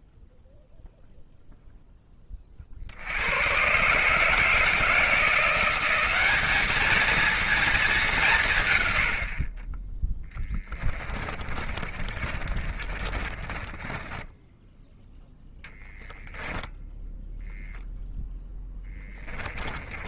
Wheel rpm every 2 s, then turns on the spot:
0, 30, 160, 200, 160, 10, 30, 10, 10, 0.
10-18